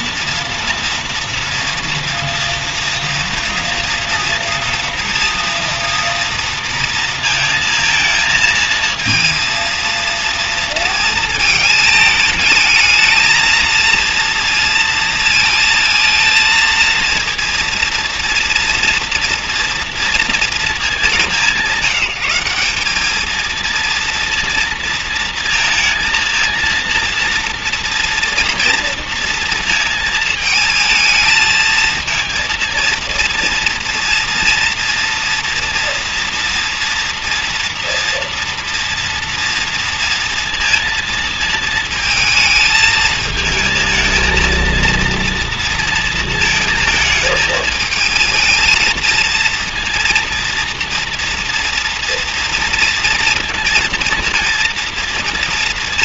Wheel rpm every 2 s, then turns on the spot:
240, 230, 230, 230, 220, 230, 220, 230, 230, 230, 220, 180, 230, 230, 230, 220, 230, 230, 230, 230, 230, 220, 230, 230, 220, 230, 230, 230.
none